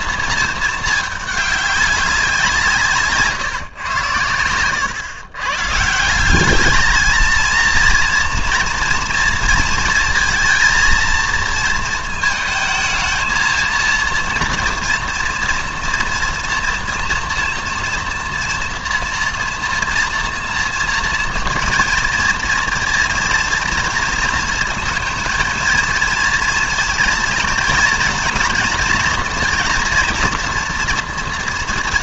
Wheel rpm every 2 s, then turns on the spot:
220, 180, 100, 220, 230, 230, 220, 230, 230, 230, 230, 230, 230, 230, 230, 240.
none